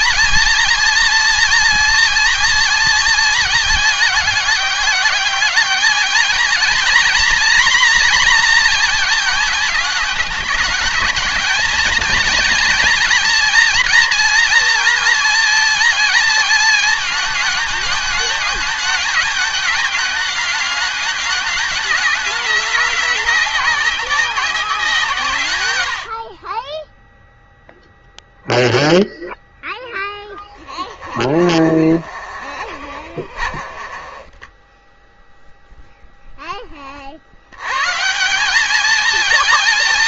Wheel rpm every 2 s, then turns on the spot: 240, 230, 200, 230, 240, 220, 240, 230, 220, 210, 210, 200, 180, 30, 0, 10, 30, 20, 10, 180.
30-36